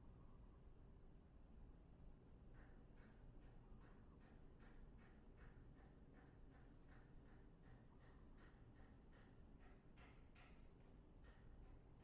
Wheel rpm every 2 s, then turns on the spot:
0, 0, 0, 0, 0, 0.
none